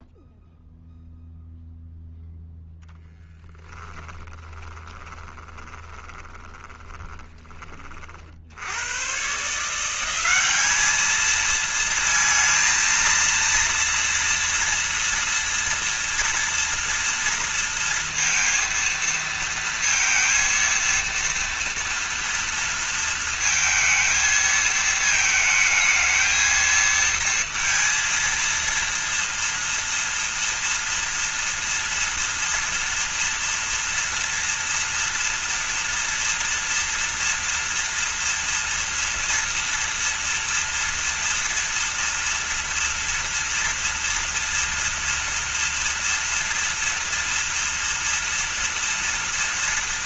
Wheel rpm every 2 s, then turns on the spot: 0, 0, 20, 20, 90, 210, 230, 230, 230, 230, 230, 230, 220, 220, 230, 230, 230, 230, 230, 230, 230, 230, 230, 230, 230.
4-8